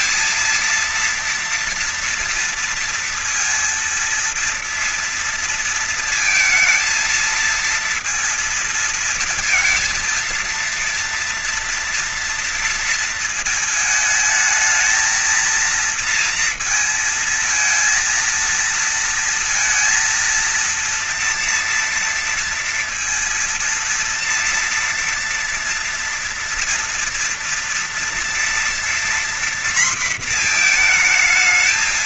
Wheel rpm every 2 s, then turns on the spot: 230, 230, 230, 230, 230, 230, 230, 220, 230, 230, 230, 230, 230, 230, 230, 230.
none